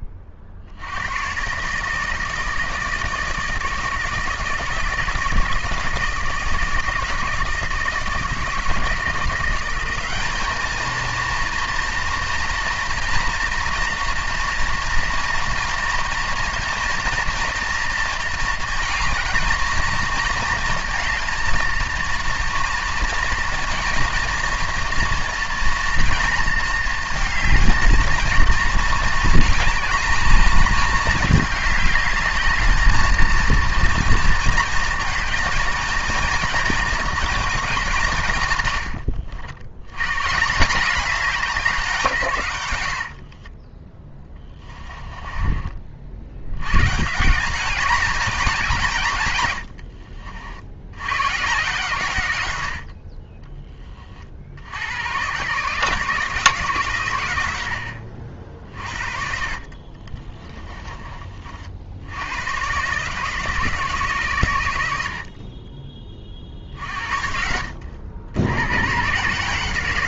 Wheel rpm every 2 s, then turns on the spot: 70, 160, 160, 160, 160, 220, 230, 230, 230, 230, 230, 230, 230, 230, 220, 210, 210, 230, 230, 120, 190, 90, 20, 120, 170, 90, 70, 90, 130, 50, 20, 130, 90, 50, 110.
44-46 58-60